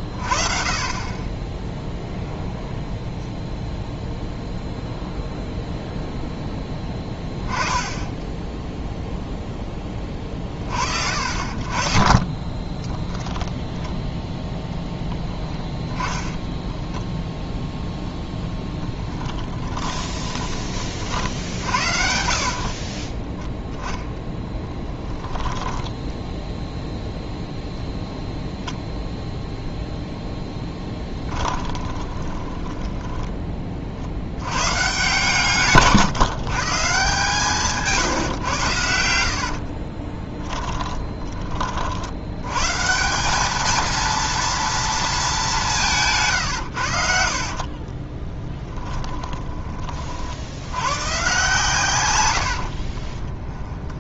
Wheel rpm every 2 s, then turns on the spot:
40, 0, 0, 10, 0, 40, 20, 0, 10, 10, 30, 40, 20, 0, 10, 10, 10, 110, 150, 110, 20, 130, 230, 100, 20, 100, 50.
12-14 16-20 22-26 30-34 40-42 48-50 52-54